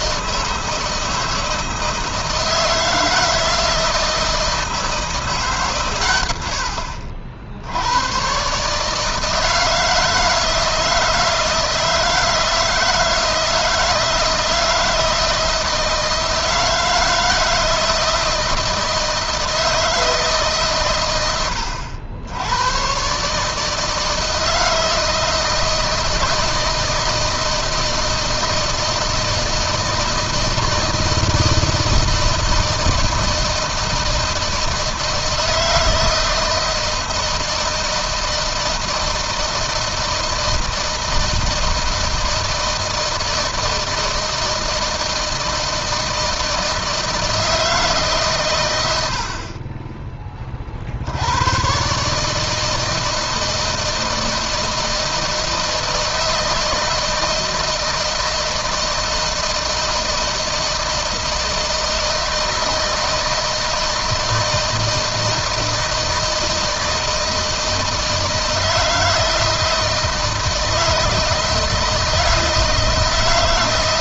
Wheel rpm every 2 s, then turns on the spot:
160, 160, 160, 60, 150, 160, 160, 170, 160, 160, 110, 130, 160, 160, 160, 160, 160, 160, 160, 160, 160, 160, 160, 160, 80, 70, 160, 160, 160, 160, 160, 160, 160, 160, 160, 160, 160.
none